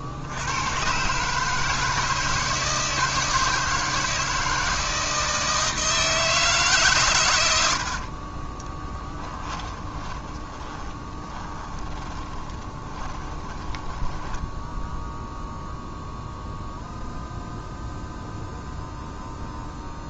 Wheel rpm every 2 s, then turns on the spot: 120, 160, 160, 150, 30, 40, 20, 10, 0, 0.
8-16